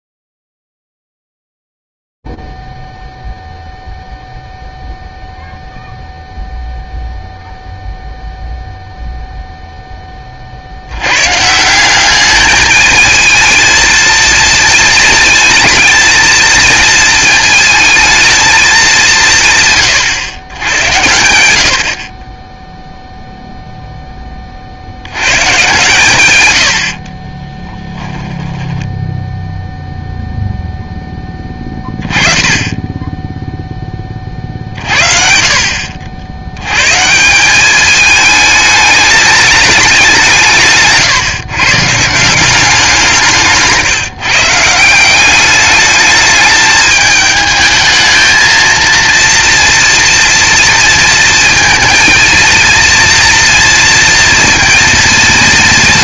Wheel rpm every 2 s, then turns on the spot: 0, 0, 0, 0, 0, 30, 210, 230, 230, 220, 110, 20, 40, 100, 10, 0, 20, 50, 110, 220, 150, 180, 160, 220, 230, 230, 230, 230.
28-30